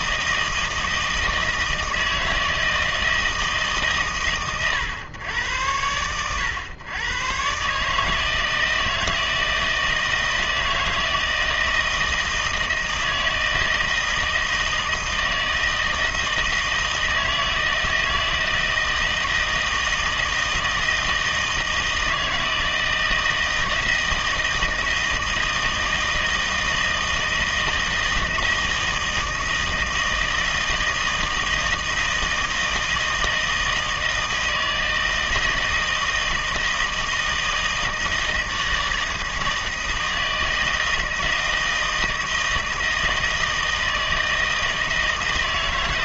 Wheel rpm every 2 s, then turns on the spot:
160, 160, 120, 100, 160, 160, 160, 160, 160, 160, 160, 160, 160, 160, 160, 160, 160, 160, 160, 160, 160, 160, 160.
none